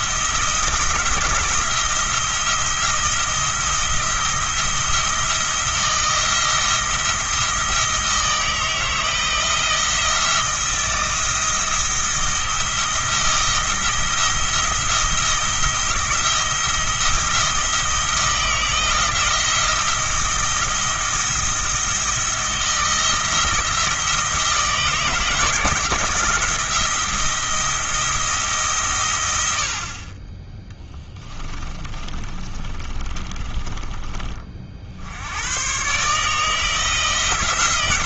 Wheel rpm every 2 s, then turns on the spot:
170, 170, 170, 170, 160, 170, 170, 170, 170, 160, 170, 170, 160, 170, 140, 10, 30, 60, 160.
30-34